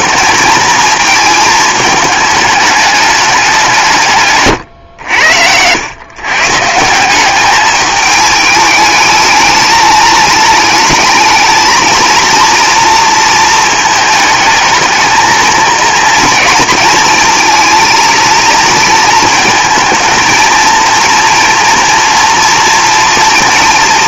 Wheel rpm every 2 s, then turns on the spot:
220, 210, 120, 160, 210, 210, 230, 220, 230, 230, 230, 230.
none